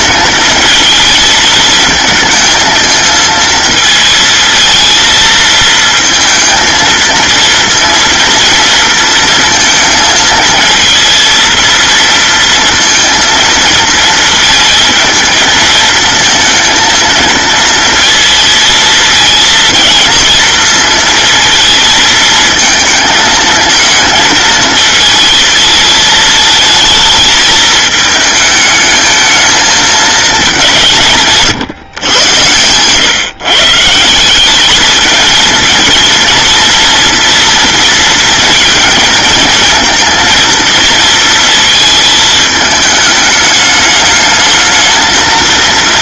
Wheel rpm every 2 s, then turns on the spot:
220, 220, 220, 230, 230, 220, 230, 230, 230, 230, 230, 220, 220, 220, 220, 180, 120, 200, 230, 230, 230, 220, 210.
none